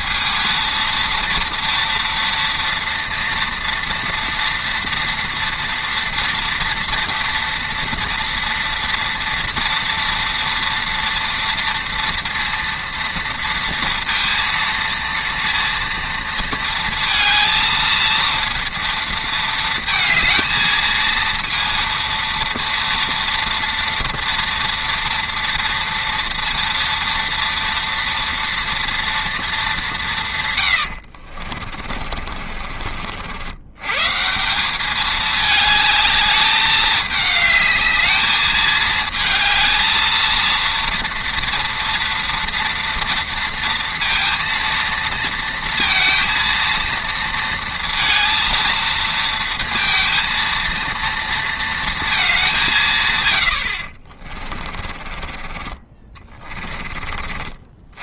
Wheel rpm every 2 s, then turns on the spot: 230, 230, 230, 230, 230, 230, 230, 230, 230, 230, 220, 230, 230, 230, 240, 110, 40, 190, 210, 220, 230, 230, 230, 230, 230, 230, 180, 40, 30.
30-34 54-58